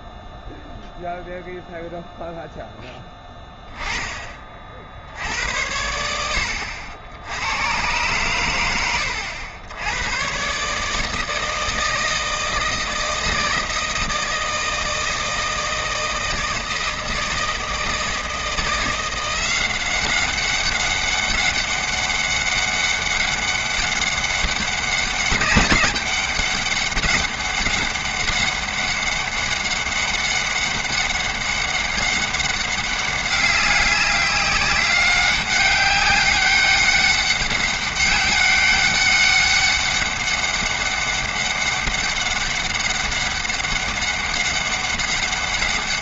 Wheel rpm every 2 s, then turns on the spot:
0, 0, 30, 80, 110, 130, 160, 160, 160, 170, 200, 200, 200, 200, 190, 200, 200, 200, 200, 190, 200, 200, 200.
none